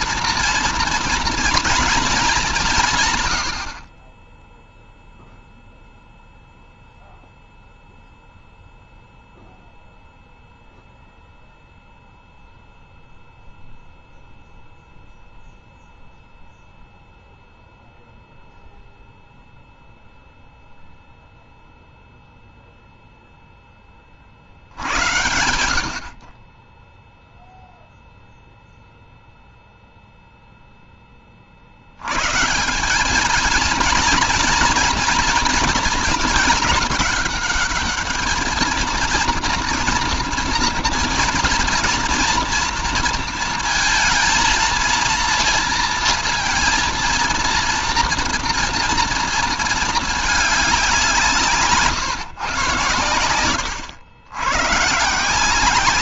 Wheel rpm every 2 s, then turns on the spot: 240, 200, 20, 0, 0, 0, 0, 0, 0, 0, 0, 0, 50, 30, 0, 0, 140, 240, 210, 220, 230, 240, 230, 230, 230, 210, 130, 100.
none